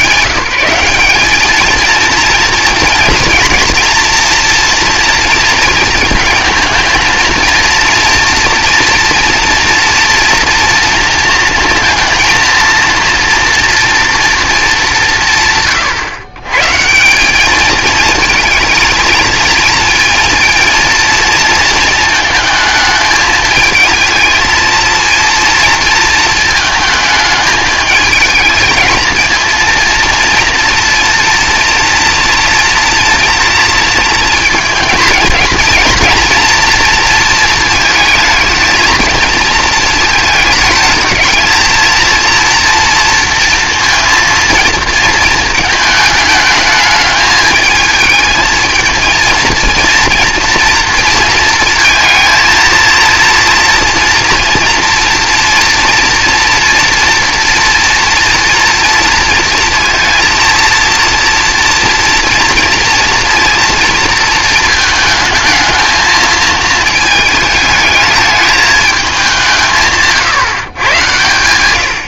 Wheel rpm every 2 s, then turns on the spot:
190, 230, 230, 220, 230, 230, 230, 180, 160, 220, 230, 220, 230, 220, 220, 230, 230, 230, 230, 220, 220, 230, 220, 210, 230, 230, 230, 240, 230, 230, 230, 230, 220, 220, 210, 110.
none